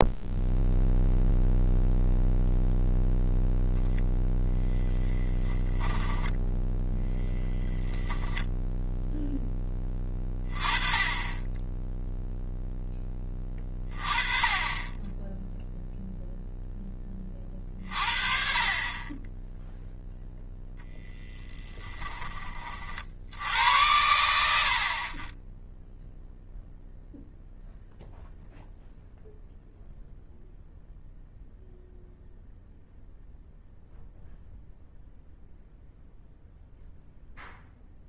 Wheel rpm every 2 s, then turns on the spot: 0, 0, 0, 0, 0, 20, 10, 20, 10, 30, 0, 30, 60, 0, 0, 0, 0, 0, 0.
none